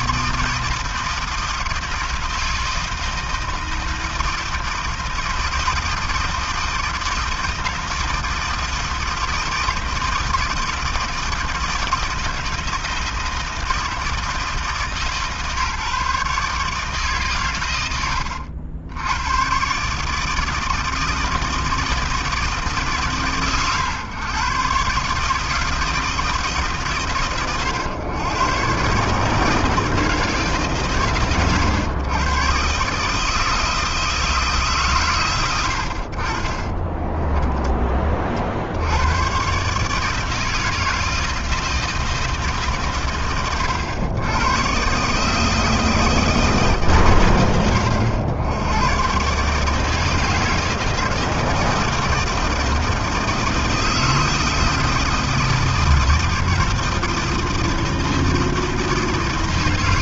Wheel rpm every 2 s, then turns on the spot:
170, 160, 160, 160, 160, 160, 160, 150, 130, 120, 160, 120, 150, 100, 150, 100, 160, 90, 10, 140, 160, 80, 160, 80, 150, 160, 160, 160, 160, 160.
36-38